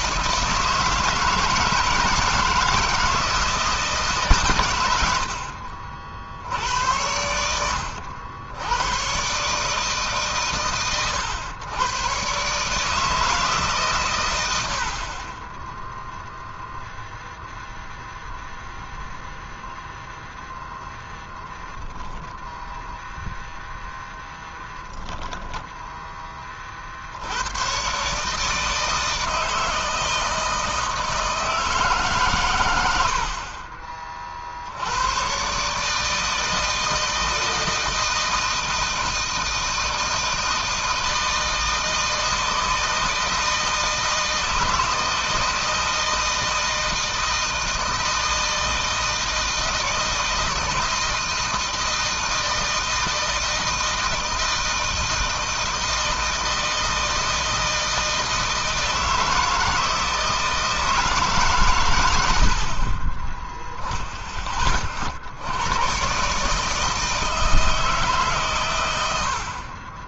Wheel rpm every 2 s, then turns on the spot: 160, 160, 80, 90, 110, 120, 150, 50, 0, 0, 10, 0, 10, 50, 160, 160, 90, 90, 160, 160, 160, 160, 160, 160, 160, 160, 160, 160, 160, 160, 160, 30, 40, 150, 110.
24-26